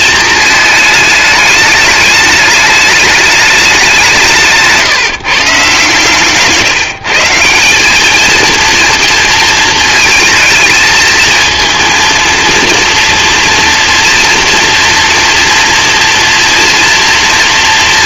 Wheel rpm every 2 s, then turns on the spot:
220, 210, 170, 150, 220, 220, 230, 240, 230.
none